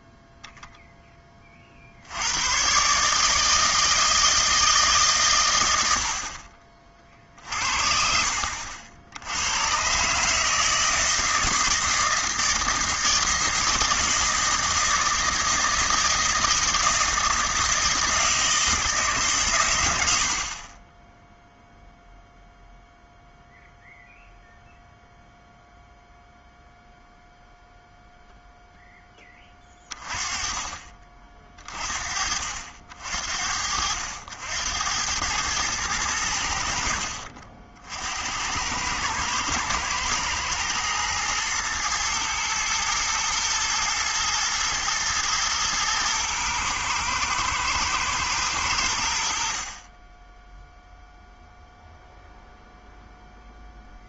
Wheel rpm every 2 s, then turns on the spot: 0, 120, 160, 30, 70, 150, 160, 160, 160, 160, 40, 0, 0, 0, 0, 20, 60, 80, 70, 90, 110, 110, 120, 110, 100, 0, 0.
none